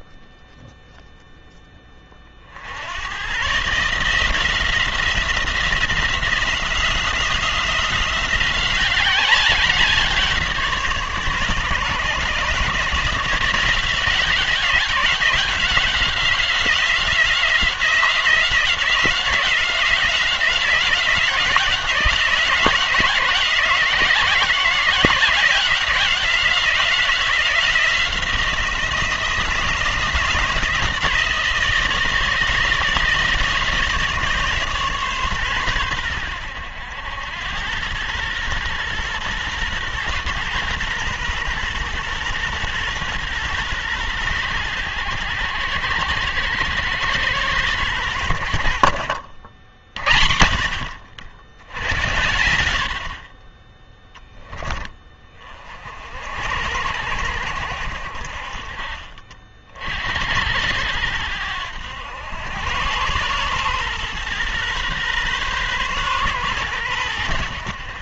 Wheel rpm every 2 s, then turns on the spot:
0, 100, 170, 170, 190, 160, 150, 180, 180, 180, 180, 180, 180, 180, 170, 160, 160, 140, 90, 120, 120, 120, 100, 110, 70, 60, 60, 20, 80, 40, 80, 110, 120, 110.
none